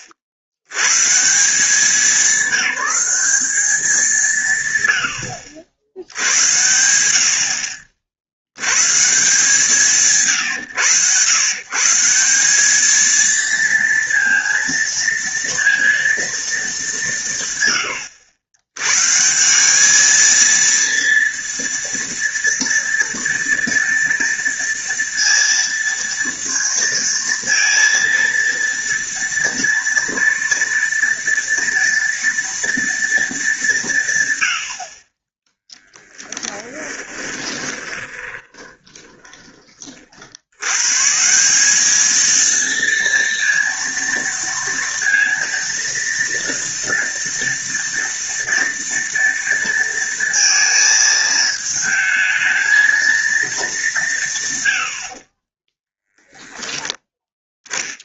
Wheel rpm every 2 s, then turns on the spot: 80, 190, 120, 80, 120, 120, 210, 230, 200, 110, 230, 230, 230, 230, 230, 230, 230, 50, 10, 20, 120, 230, 230, 230, 230, 230, 220, 110, 10.
36-40